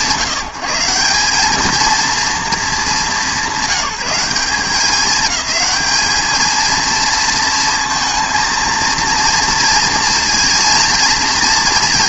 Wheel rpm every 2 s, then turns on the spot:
180, 210, 200, 220, 230, 230.
none